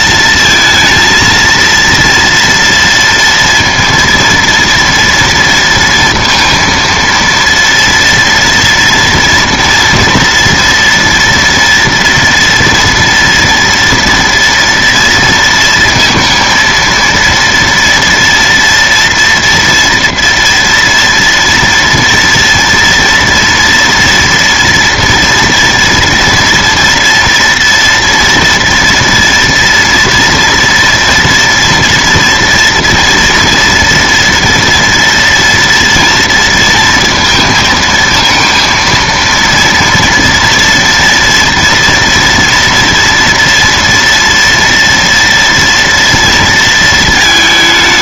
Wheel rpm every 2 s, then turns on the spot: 230, 230, 230, 230, 230, 230, 230, 230, 230, 240, 240, 230, 240, 230, 240, 230, 240, 230, 230, 230, 230, 230, 230, 230.
none